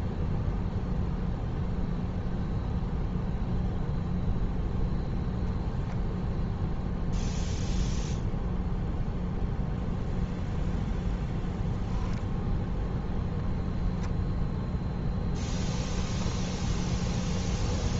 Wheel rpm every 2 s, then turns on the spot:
0, 0, 0, 0, 0, 0, 10, 0, 0.
none